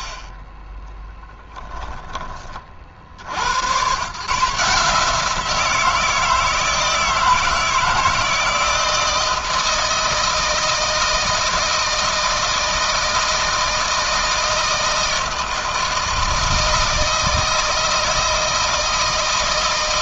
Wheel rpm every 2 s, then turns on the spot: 10, 50, 160, 160, 160, 160, 160, 160, 160, 160.
0-2